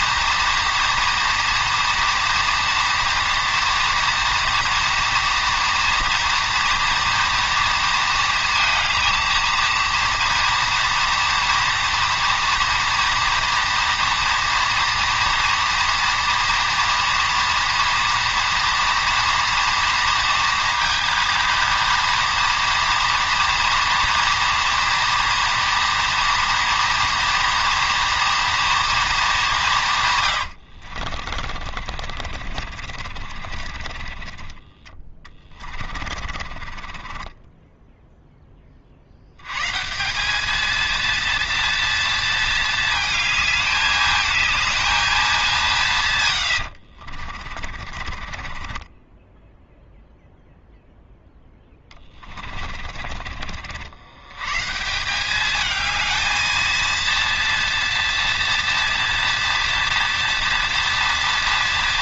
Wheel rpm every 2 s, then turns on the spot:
230, 230, 240, 230, 230, 230, 240, 230, 230, 230, 230, 230, 230, 230, 230, 80, 60, 20, 30, 20, 220, 220, 220, 90, 30, 0, 30, 120, 220, 230, 230.
30-34 36-38 46-50 52-54